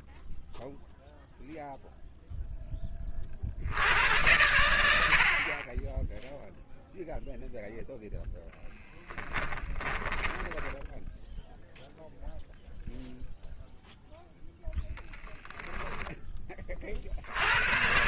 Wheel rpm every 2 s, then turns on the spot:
0, 60, 70, 0, 10, 0, 0, 20, 40.
8-10 14-16